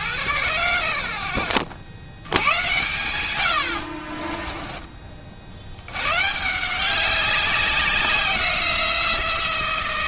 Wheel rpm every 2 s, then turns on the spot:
110, 110, 20, 170, 180.
4-6